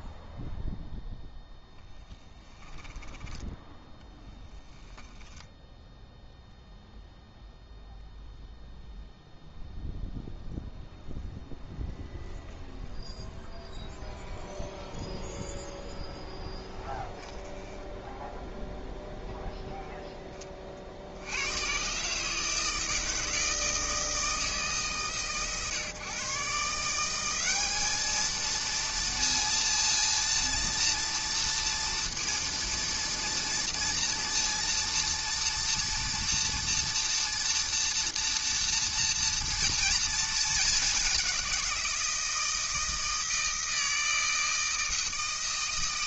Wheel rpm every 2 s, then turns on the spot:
0, 10, 10, 0, 0, 0, 0, 0, 10, 0, 30, 160, 150, 150, 230, 230, 230, 230, 230, 230, 210, 160, 160.
16-18